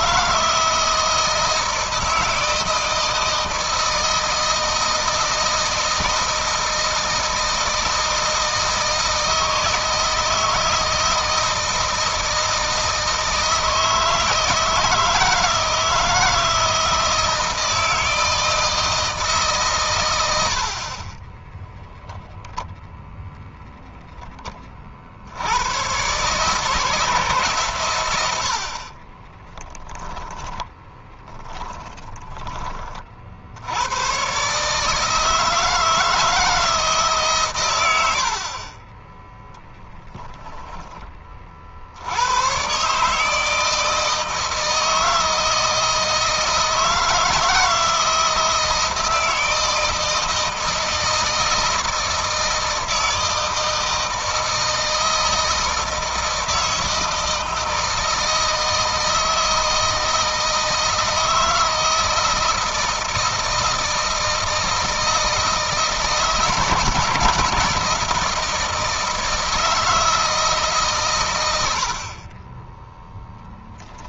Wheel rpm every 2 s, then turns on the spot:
160, 160, 160, 160, 160, 160, 160, 160, 160, 160, 70, 0, 20, 150, 70, 20, 30, 140, 160, 40, 20, 130, 160, 160, 160, 160, 160, 160, 160, 160, 160, 160, 160, 160, 160, 150, 20.
30-32